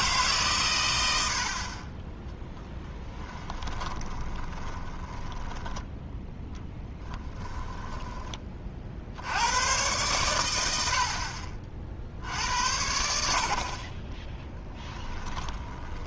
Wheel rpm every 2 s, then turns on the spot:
110, 10, 10, 10, 50, 70, 70, 30.
2-8 14-16